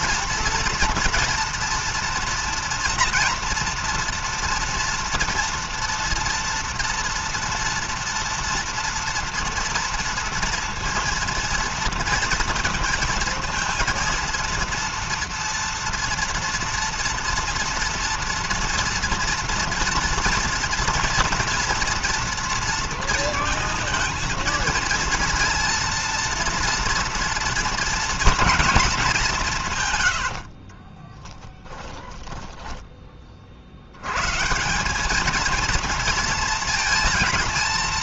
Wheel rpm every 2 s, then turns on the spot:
230, 240, 240, 230, 240, 230, 230, 230, 230, 230, 230, 230, 230, 230, 230, 80, 10, 140, 230.
30-34